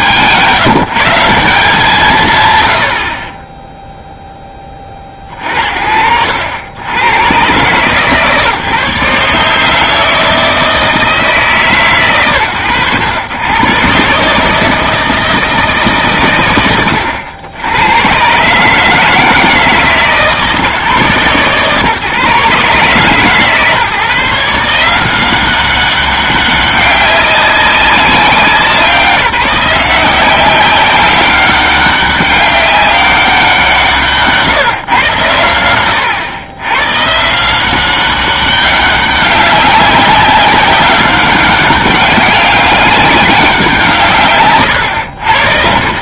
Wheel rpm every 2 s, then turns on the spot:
180, 60, 10, 80, 140, 160, 100, 160, 80, 160, 130, 140, 180, 200, 180, 190, 200, 130, 120, 190, 190, 190, 100.
none